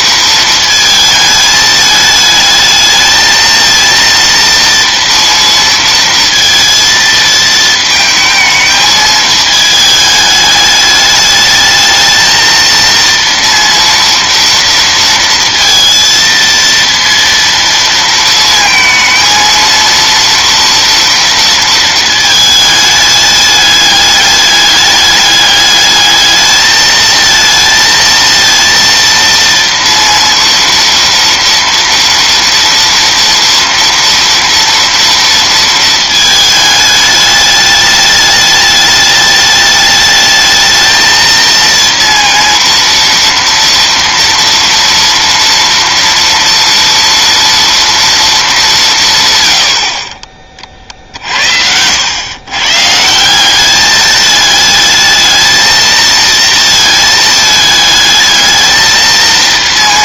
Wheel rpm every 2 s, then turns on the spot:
220, 220, 230, 230, 220, 210, 230, 230, 230, 230, 230, 220, 210, 220, 230, 230, 230, 230, 220, 210, 220, 230, 230, 230, 190, 30, 130, 210, 230, 220.
none